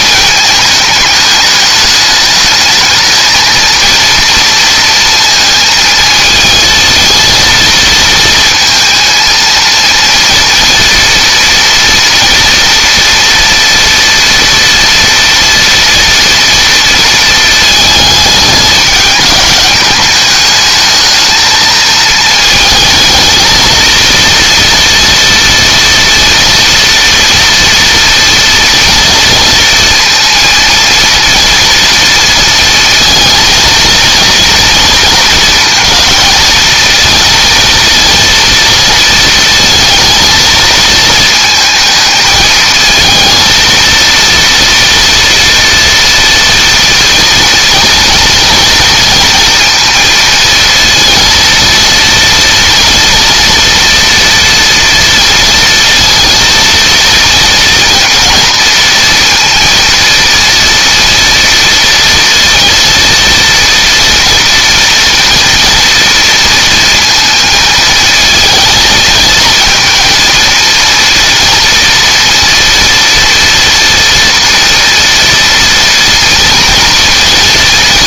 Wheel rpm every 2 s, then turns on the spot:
210, 220, 230, 230, 230, 230, 240, 230, 230, 210, 220, 220, 230, 230, 230, 230, 230, 220, 230, 230, 220, 220, 230, 230, 230, 230, 230, 230, 230, 230, 230, 230, 230, 230, 230, 230, 230, 230, 230.
none